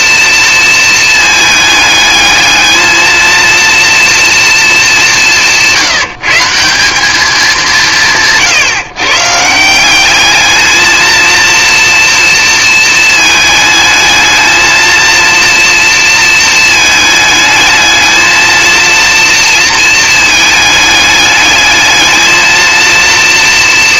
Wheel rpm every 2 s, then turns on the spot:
220, 220, 210, 190, 140, 230, 230, 230, 220, 230, 210, 230.
none